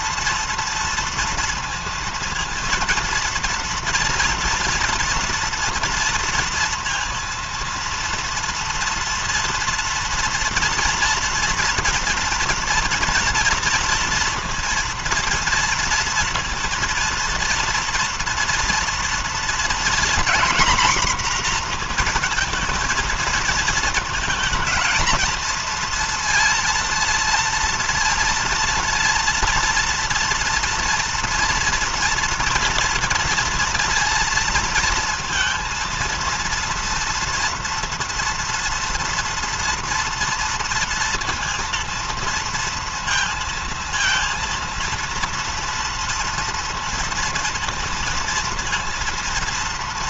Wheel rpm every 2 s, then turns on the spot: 230, 230, 230, 230, 230, 230, 230, 230, 230, 230, 250, 230, 230, 230, 230, 230, 230, 230, 230, 230, 230, 230, 230, 230, 230.
none